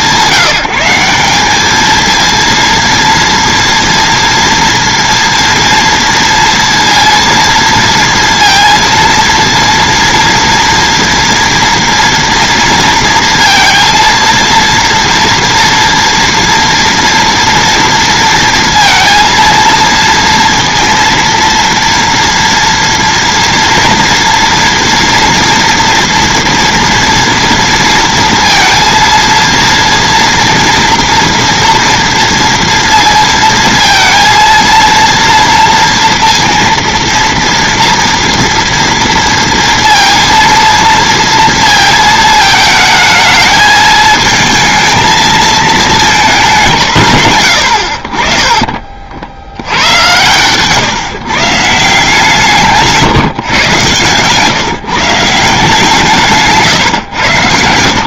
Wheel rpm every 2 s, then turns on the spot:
190, 230, 230, 230, 230, 230, 230, 230, 230, 230, 230, 230, 230, 230, 230, 230, 230, 230, 230, 230, 230, 220, 220, 160, 40, 140, 160, 150, 140.
56-58